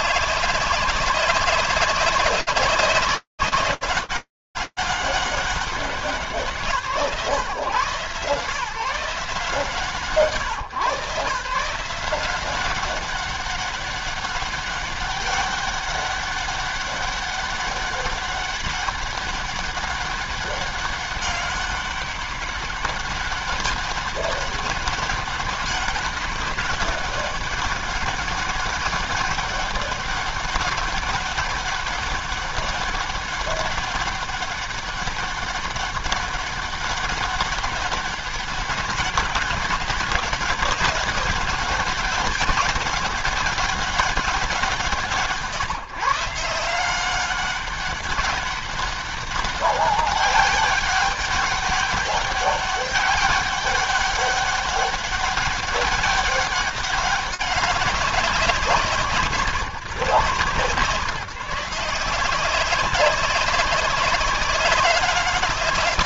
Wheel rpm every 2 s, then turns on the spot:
190, 190, 190, 150, 150, 150, 200, 200, 200, 200, 190, 200, 200, 200, 200, 200, 200, 200, 200, 200, 190, 200, 160, 180, 200, 200, 190, 200, 200, 160, 150, 190, 200.
none